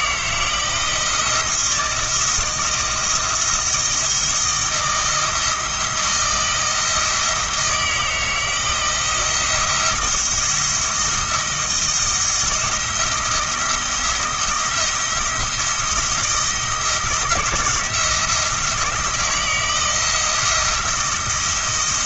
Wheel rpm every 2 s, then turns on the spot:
160, 170, 170, 160, 160, 170, 170, 170, 160, 170, 170.
none